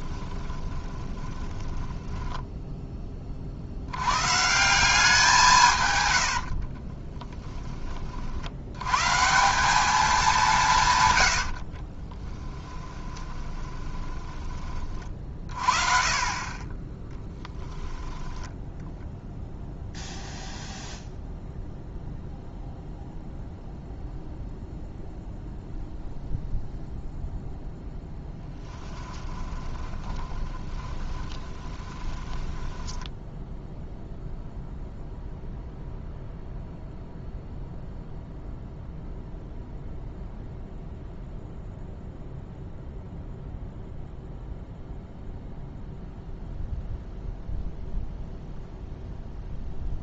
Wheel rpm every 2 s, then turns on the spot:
20, 10, 180, 30, 130, 130, 10, 30, 10, 0, 0, 0, 0, 0, 10, 20, 10, 0, 0, 0, 0, 0, 0, 0, 0.
0-2 6-8 10-14 28-34